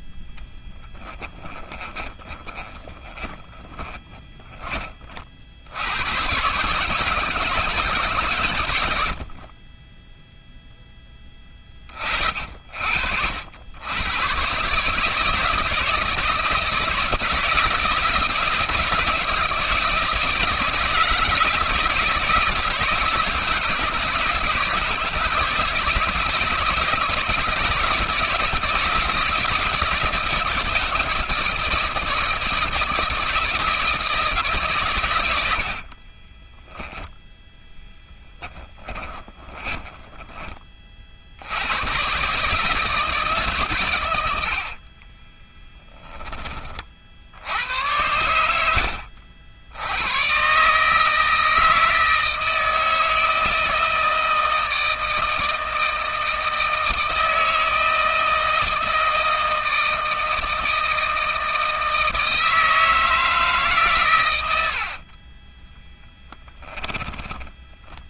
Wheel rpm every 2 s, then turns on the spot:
10, 20, 40, 150, 80, 10, 60, 150, 160, 160, 160, 160, 160, 170, 160, 160, 160, 120, 10, 20, 50, 160, 40, 50, 70, 150, 160, 160, 160, 160, 160, 160, 60, 10.
0-4 36-40 44-46 64-66